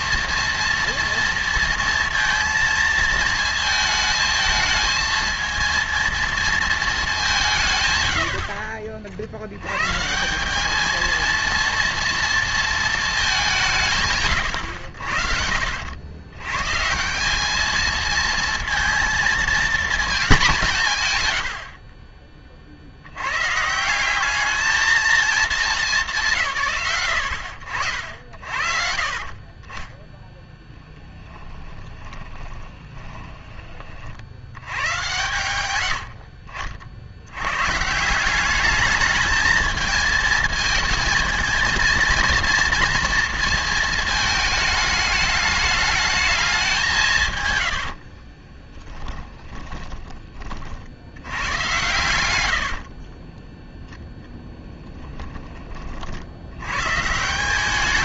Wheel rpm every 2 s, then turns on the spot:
230, 230, 220, 210, 50, 220, 220, 90, 160, 230, 150, 70, 220, 110, 40, 10, 20, 120, 60, 210, 230, 230, 220, 170, 10, 80, 40, 10, 130.
32-34 52-54